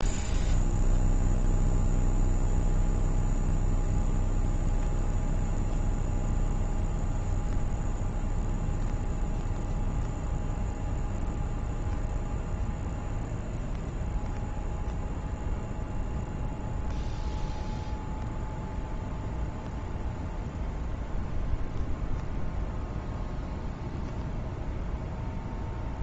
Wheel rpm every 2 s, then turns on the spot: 0, 0, 0, 0, 0, 0, 0, 0, 0, 0, 0, 0, 0.
none